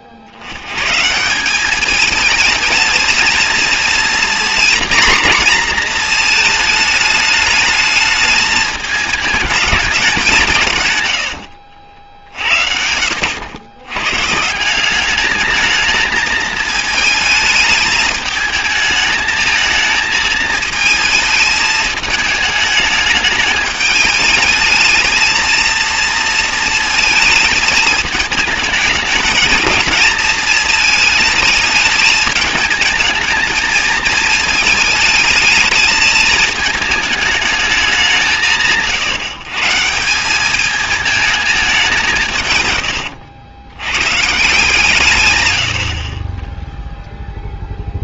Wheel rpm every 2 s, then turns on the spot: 70, 220, 230, 220, 220, 140, 70, 180, 220, 220, 220, 210, 220, 220, 220, 220, 220, 220, 220, 150, 210, 120, 170, 10.
none